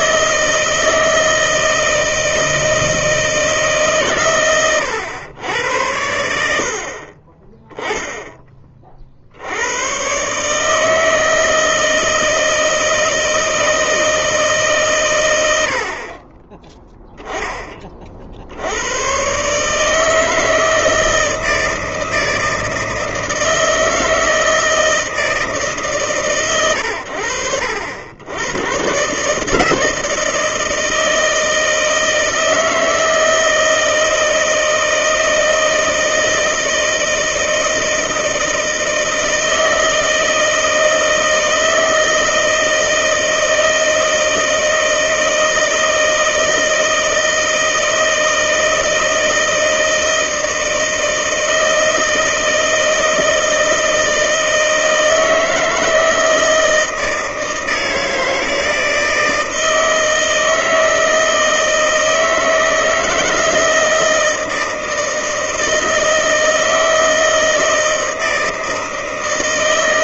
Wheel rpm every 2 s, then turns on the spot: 160, 160, 110, 60, 20, 150, 160, 150, 10, 80, 160, 160, 160, 120, 110, 160, 160, 160, 160, 160, 160, 160, 160, 160, 160, 160, 160, 160, 160, 160, 160, 160, 160, 160, 160.
none